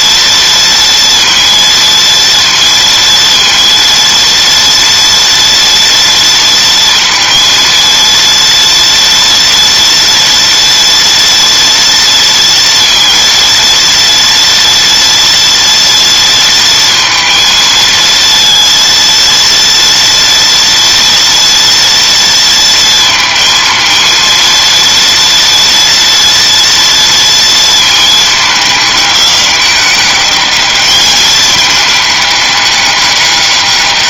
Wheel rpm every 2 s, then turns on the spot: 230, 230, 230, 230, 230, 230, 230, 240, 230, 230, 230, 230, 230, 230, 210, 210, 200.
none